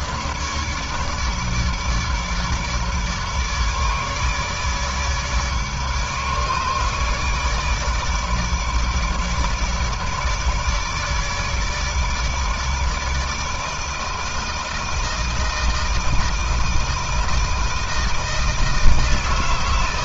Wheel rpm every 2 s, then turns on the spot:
150, 150, 150, 150, 150, 160, 150, 160, 160, 160.
none